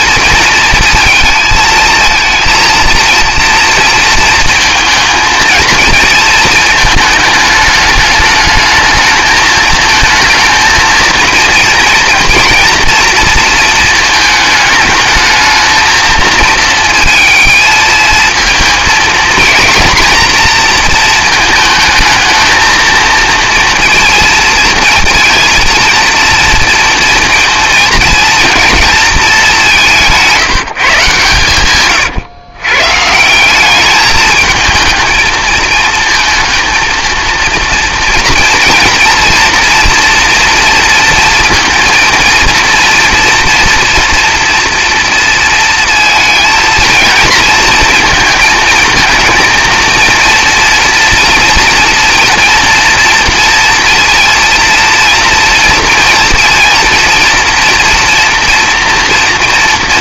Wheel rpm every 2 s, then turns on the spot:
220, 230, 230, 220, 210, 230, 230, 220, 230, 230, 240, 220, 230, 230, 230, 170, 140, 220, 230, 230, 230, 230, 230, 220, 220, 230, 230, 230, 230, 230.
none